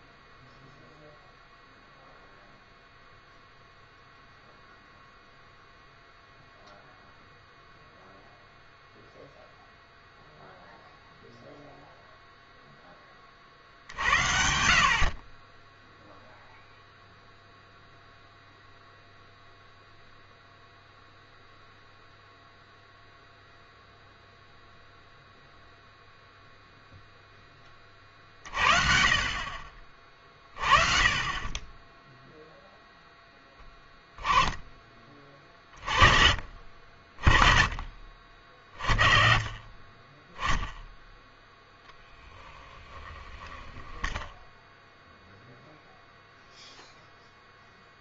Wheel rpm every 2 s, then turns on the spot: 0, 0, 0, 0, 0, 0, 0, 60, 0, 0, 0, 0, 0, 0, 40, 30, 0, 10, 40, 30, 0, 10, 0, 0.
none